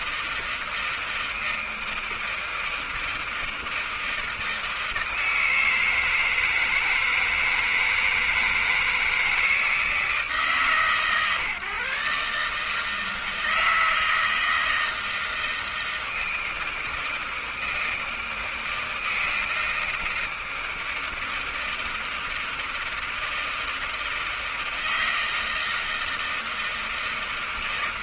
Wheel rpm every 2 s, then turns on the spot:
160, 160, 160, 160, 160, 160, 140, 160, 160, 160, 160, 160, 160, 160.
none